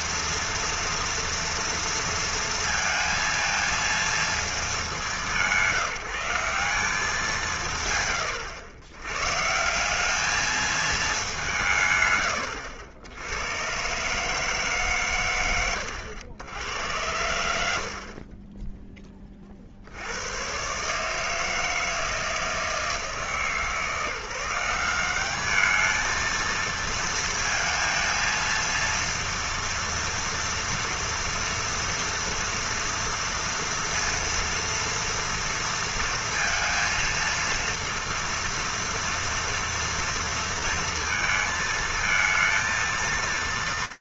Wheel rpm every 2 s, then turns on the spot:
230, 230, 170, 150, 160, 180, 110, 110, 90, 20, 150, 160, 200, 230, 230, 240, 230, 230, 230, 230, 230, 230.
none